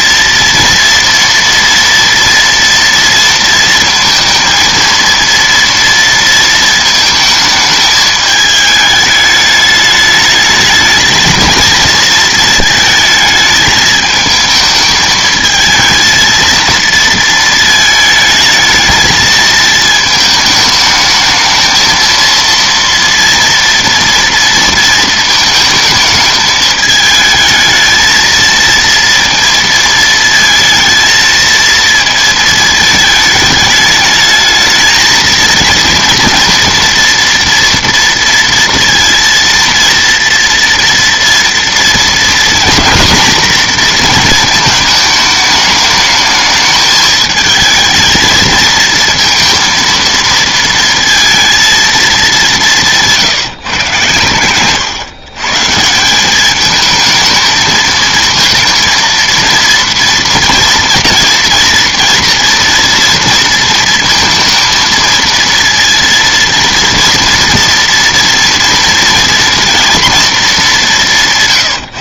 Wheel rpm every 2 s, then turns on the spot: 230, 230, 230, 220, 210, 210, 220, 220, 220, 220, 220, 230, 230, 220, 230, 230, 220, 220, 230, 230, 230, 230, 220, 210, 230, 230, 200, 120, 210, 230, 230, 230, 230, 230, 230, 210.
none